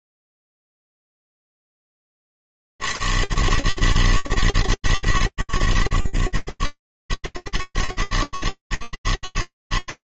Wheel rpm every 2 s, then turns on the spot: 60, 110, 110, 80, 110.
none